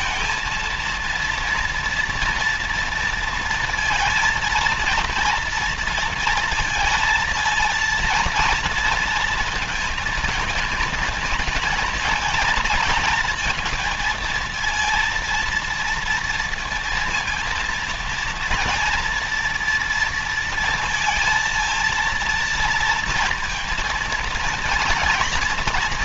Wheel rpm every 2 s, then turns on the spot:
230, 230, 230, 230, 230, 220, 230, 230, 230, 230, 230, 230, 230.
none